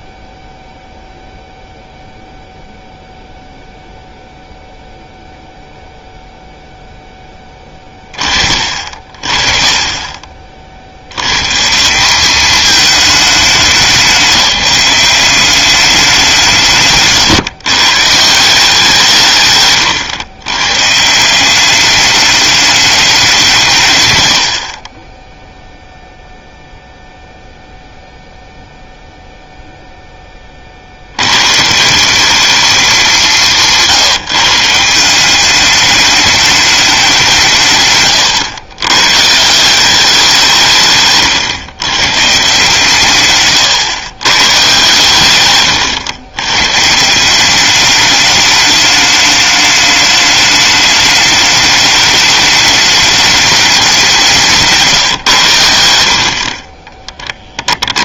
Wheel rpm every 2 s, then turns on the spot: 0, 0, 0, 0, 40, 60, 210, 180, 160, 170, 140, 210, 40, 0, 0, 60, 200, 170, 210, 120, 150, 130, 130, 140, 210, 210, 210, 160, 20.
54-56